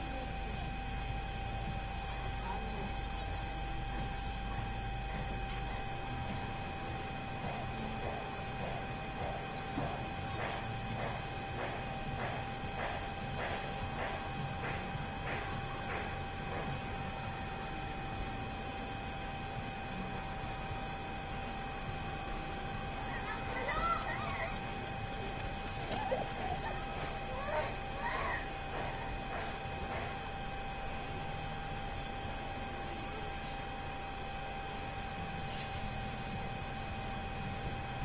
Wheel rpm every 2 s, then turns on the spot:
0, 0, 0, 0, 0, 0, 0, 0, 0, 0, 0, 0, 0, 0, 0, 0, 0, 0, 0.
none